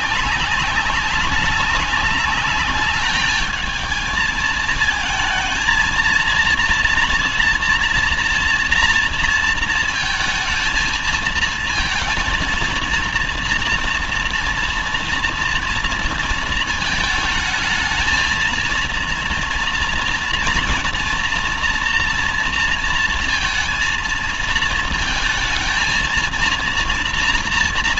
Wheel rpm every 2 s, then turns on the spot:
200, 210, 220, 230, 230, 220, 230, 230, 230, 220, 230, 230, 230, 230.
none